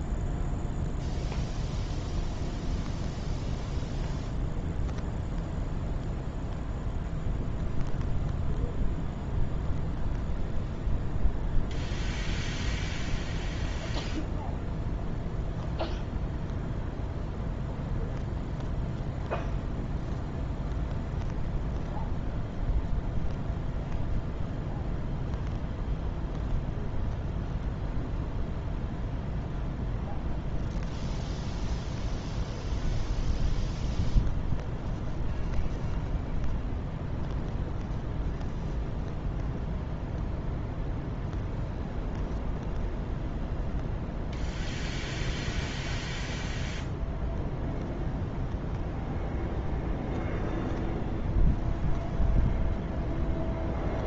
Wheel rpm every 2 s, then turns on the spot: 0, 0, 0, 0, 0, 0, 0, 0, 0, 0, 0, 0, 0, 0, 0, 0, 0, 0, 0, 0, 0, 0, 0, 0, 0, 0, 0.
none